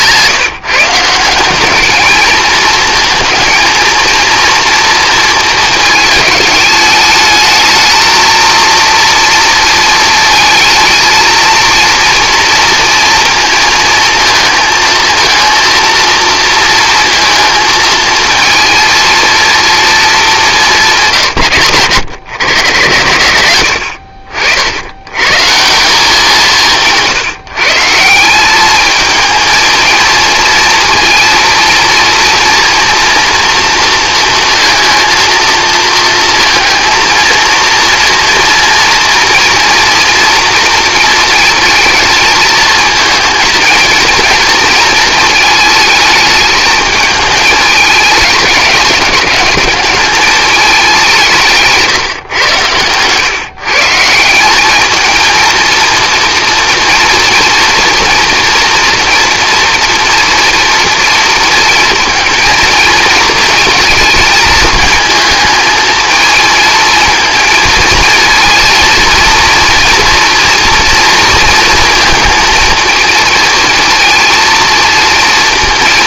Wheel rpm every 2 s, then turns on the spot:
160, 220, 230, 210, 230, 220, 230, 220, 230, 220, 190, 120, 80, 160, 210, 230, 230, 230, 230, 230, 230, 220, 220, 220, 200, 200, 120, 200, 230, 240, 230, 230, 220, 220, 230, 230, 230, 230.
20-22 52-54